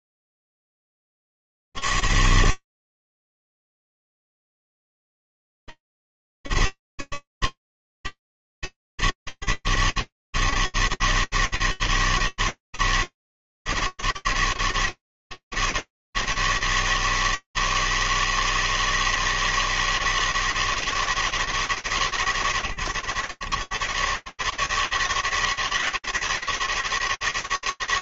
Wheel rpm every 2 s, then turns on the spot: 70, 160, 160, 160, 160, 160, 160, 160, 160, 160, 160, 160, 120, 160.
none